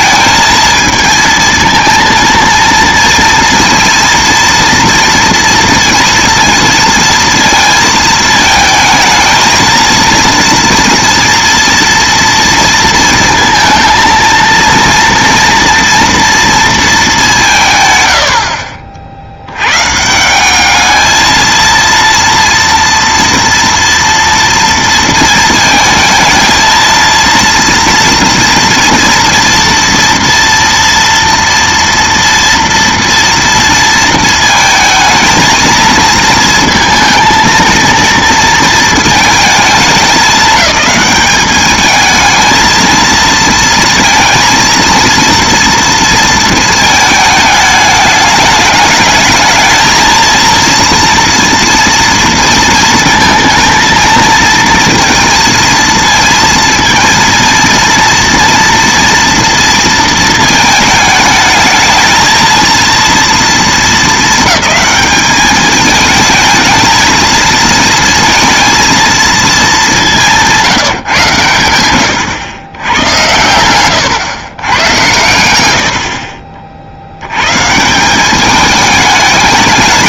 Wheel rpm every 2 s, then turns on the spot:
230, 230, 230, 230, 220, 230, 230, 230, 230, 60, 210, 230, 230, 230, 230, 230, 230, 220, 230, 230, 210, 220, 230, 220, 210, 230, 230, 230, 230, 230, 220, 230, 220, 220, 230, 170, 110, 110, 100, 210.
72-74